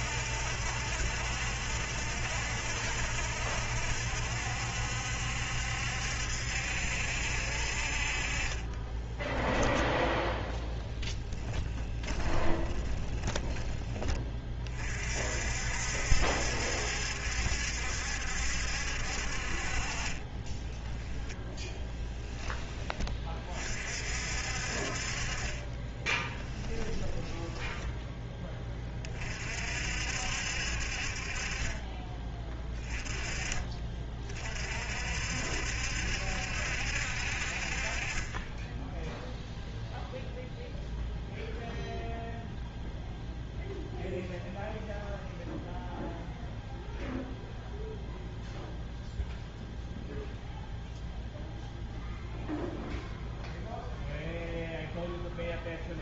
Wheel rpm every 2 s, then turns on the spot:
70, 70, 70, 70, 20, 0, 20, 40, 70, 60, 20, 20, 50, 20, 20, 50, 20, 50, 70, 10, 0, 0, 0, 0, 0, 0, 0, 0.
8-10 12-14 20-22 26-28